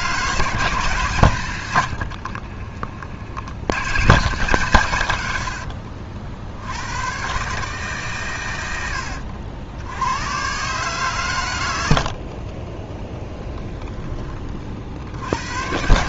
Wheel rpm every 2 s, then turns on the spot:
150, 40, 130, 100, 90, 130, 20, 60.
12-14